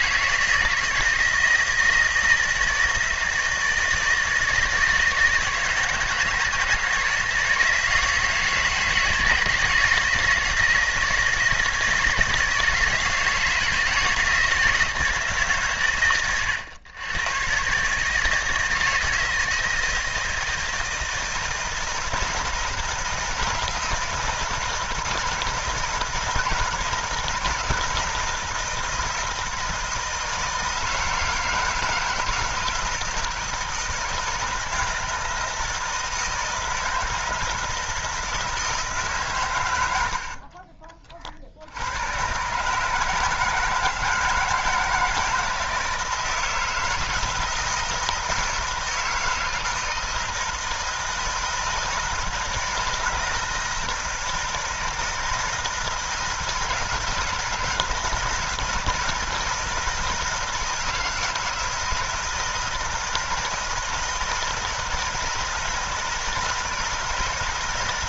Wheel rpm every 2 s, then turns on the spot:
160, 160, 160, 160, 160, 160, 160, 160, 110, 160, 160, 160, 160, 160, 160, 160, 160, 160, 160, 160, 40, 140, 160, 160, 160, 160, 160, 160, 160, 160, 160, 160, 160, 160.
40-42